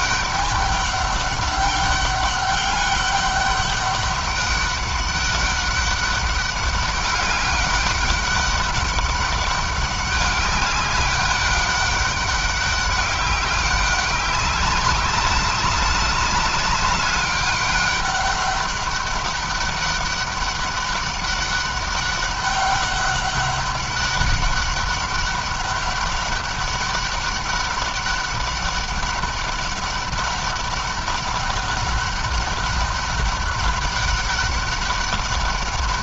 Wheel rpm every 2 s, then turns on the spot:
200, 200, 200, 200, 200, 200, 200, 200, 200, 200, 200, 200, 200, 190, 200, 200, 200, 200.
none